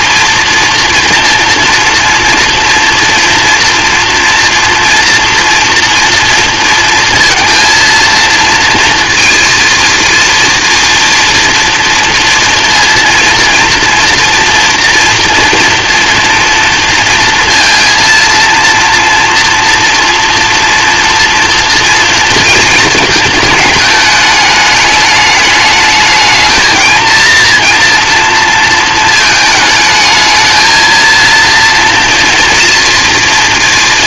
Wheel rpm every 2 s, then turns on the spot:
230, 230, 230, 230, 230, 230, 230, 230, 230, 230, 230, 220, 210, 220, 220, 220, 230.
none